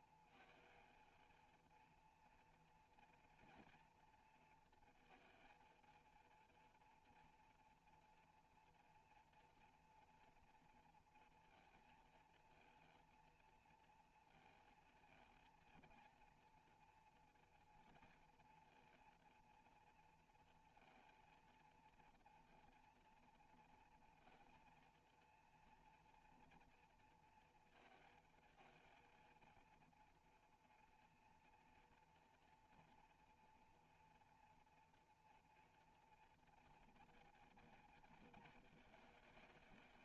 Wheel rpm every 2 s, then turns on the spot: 230, 240, 230, 230, 230, 230, 230, 230, 230, 230, 230, 240, 230, 230, 230, 230, 230, 230, 230, 230.
none